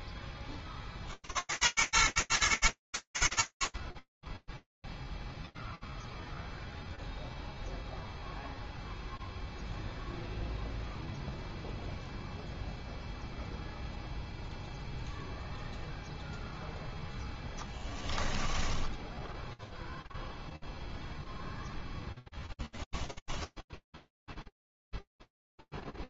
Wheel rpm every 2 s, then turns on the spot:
50, 90, 0, 0, 0, 0, 0, 0, 0, 10, 0, 10, 0.
18-20 22-24